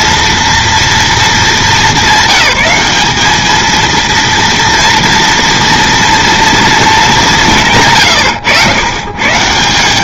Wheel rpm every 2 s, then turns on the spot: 220, 210, 230, 220, 120.
none